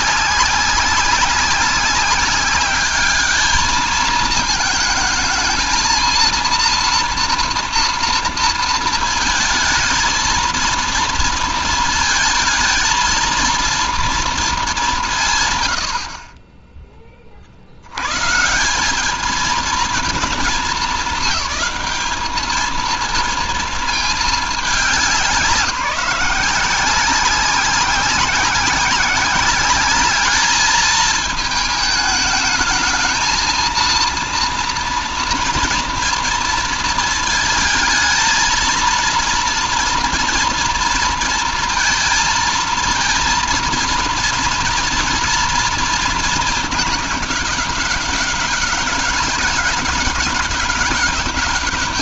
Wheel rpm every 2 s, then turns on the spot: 200, 210, 220, 230, 230, 220, 230, 210, 30, 180, 200, 220, 210, 180, 190, 220, 220, 230, 230, 230, 230, 220, 230, 210, 200, 190.
none